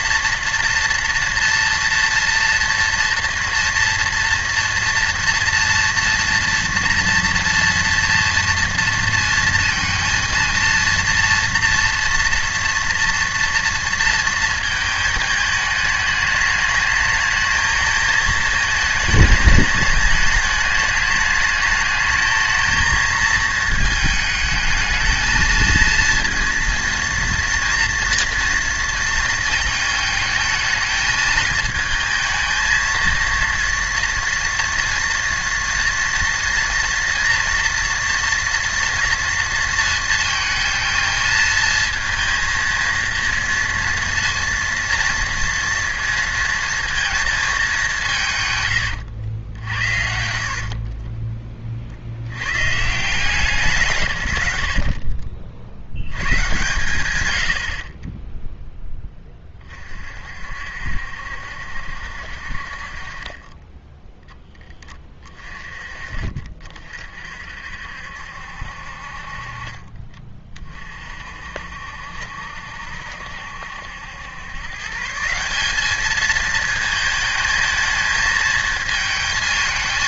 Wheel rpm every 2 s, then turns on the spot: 230, 230, 230, 230, 230, 230, 230, 230, 210, 220, 210, 220, 210, 230, 230, 220, 220, 230, 230, 230, 230, 230, 230, 230, 120, 40, 120, 80, 120, 0, 60, 50, 10, 40, 60, 30, 70, 130, 220, 220.
48-52